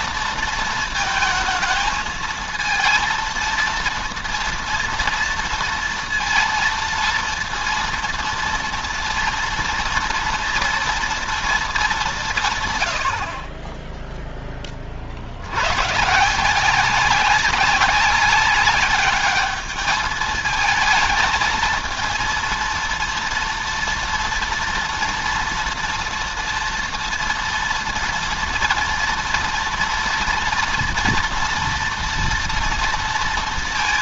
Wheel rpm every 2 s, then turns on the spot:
230, 220, 230, 230, 230, 230, 110, 40, 180, 210, 220, 230, 230, 230, 230, 230, 230.
none